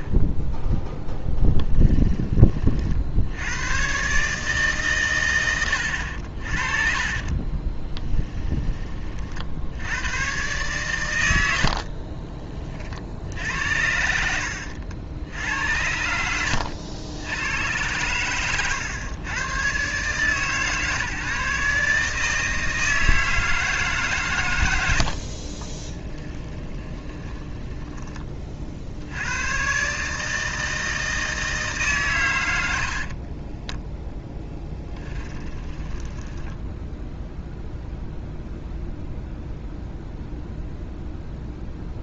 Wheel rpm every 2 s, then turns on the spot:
0, 40, 120, 40, 30, 120, 30, 80, 90, 120, 150, 160, 100, 20, 50, 160, 100, 10, 10, 0, 0.
18-20 26-28 34-38